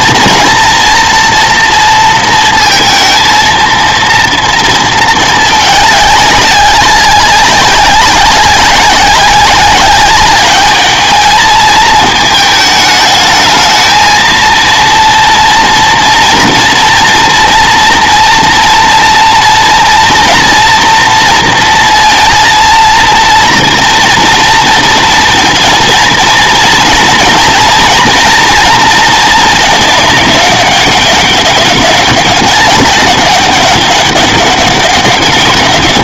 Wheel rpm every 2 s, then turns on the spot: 240, 230, 230, 200, 200, 210, 210, 230, 230, 230, 240, 230, 230, 240, 230, 200, 200, 200.
none